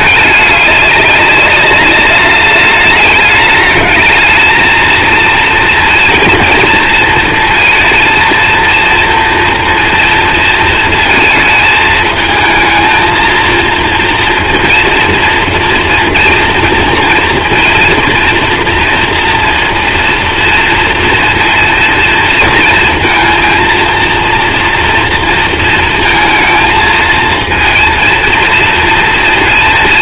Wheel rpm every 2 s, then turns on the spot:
200, 210, 220, 230, 230, 230, 220, 230, 230, 230, 230, 230, 230, 220, 230.
none